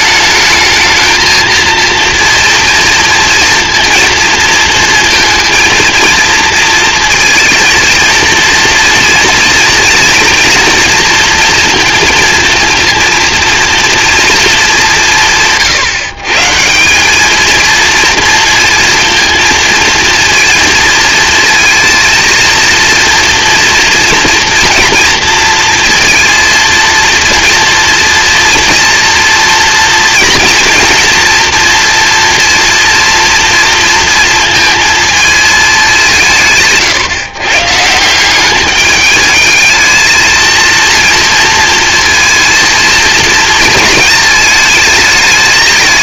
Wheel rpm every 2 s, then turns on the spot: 220, 230, 230, 230, 230, 230, 230, 200, 170, 230, 230, 230, 230, 230, 230, 230, 230, 220, 140, 210, 230, 230, 220.
none